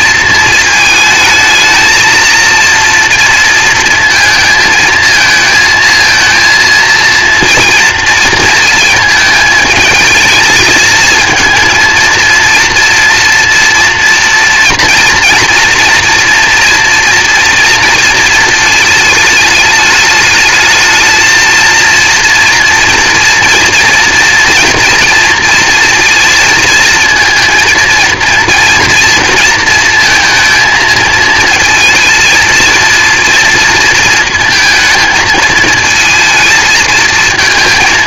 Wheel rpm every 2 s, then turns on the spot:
220, 230, 220, 230, 230, 210, 230, 230, 230, 220, 220, 230, 230, 230, 230, 230, 230, 220, 220.
none